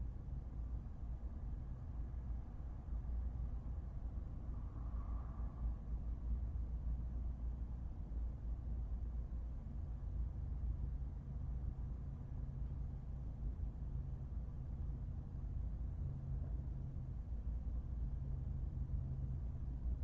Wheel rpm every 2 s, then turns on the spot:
0, 0, 0, 0, 0, 0, 0, 0, 0, 0.
none